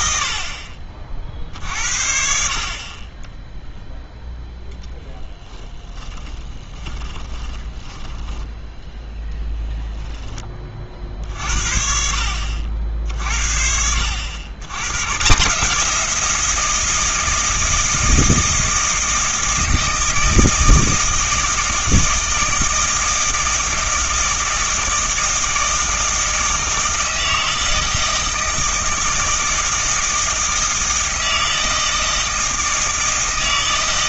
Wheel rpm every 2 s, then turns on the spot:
40, 40, 10, 20, 0, 40, 60, 110, 170, 160, 160, 160, 160, 160, 160, 160, 160.
6-8